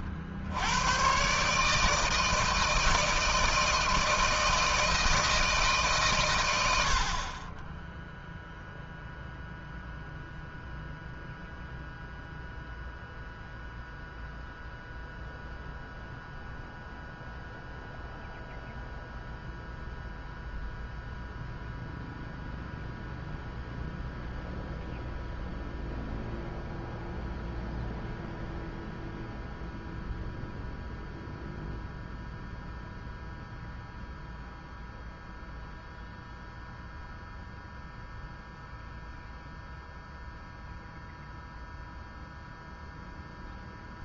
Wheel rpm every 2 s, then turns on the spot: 120, 160, 160, 70, 0, 0, 0, 0, 0, 0, 0, 0, 0, 0, 0, 0, 0, 0, 0, 0, 0, 0.
none